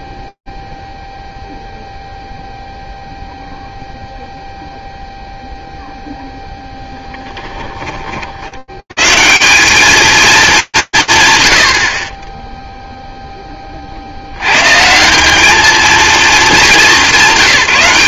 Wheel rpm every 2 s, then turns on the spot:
0, 0, 0, 0, 90, 150, 0, 140, 200.
none